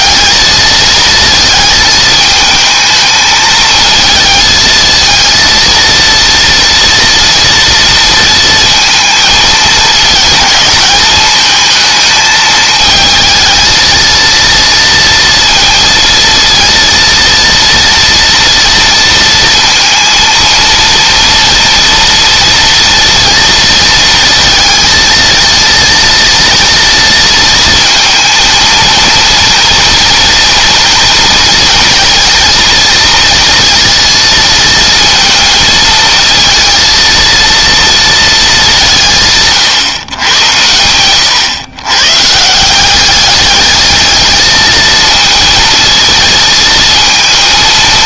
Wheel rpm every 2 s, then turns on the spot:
220, 220, 220, 230, 220, 220, 220, 230, 230, 230, 230, 230, 230, 230, 230, 230, 230, 230, 230, 180, 110, 190, 220, 230.
none